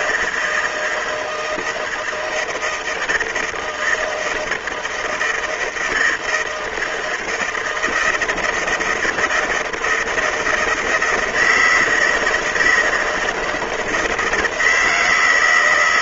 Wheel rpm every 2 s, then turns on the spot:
160, 160, 160, 160, 170, 160, 160, 160.
none